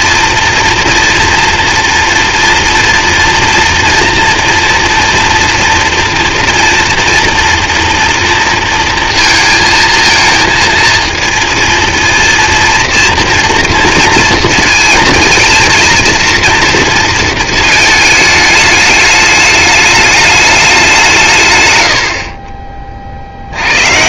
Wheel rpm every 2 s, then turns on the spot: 240, 230, 230, 230, 230, 230, 230, 220, 230, 210, 200, 30.
none